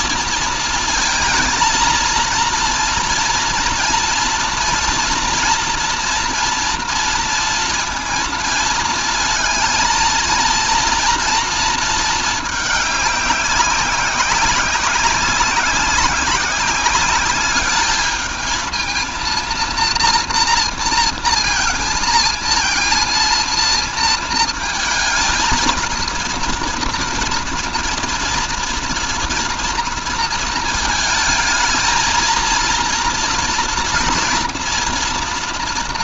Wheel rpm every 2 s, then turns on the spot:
220, 230, 230, 230, 230, 230, 210, 190, 190, 220, 230, 230, 220, 230, 230, 220, 230, 230.
none